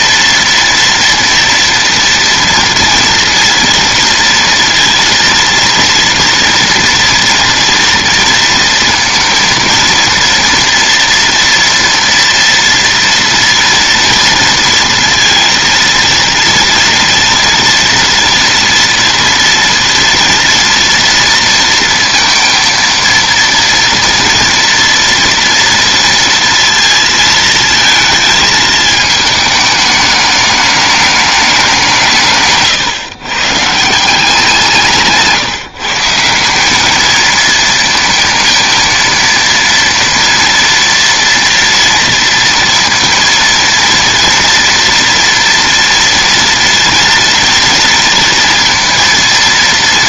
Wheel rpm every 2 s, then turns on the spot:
230, 230, 230, 230, 230, 230, 230, 230, 230, 230, 240, 230, 230, 230, 220, 210, 130, 170, 190, 220, 230, 230, 230, 230, 230.
none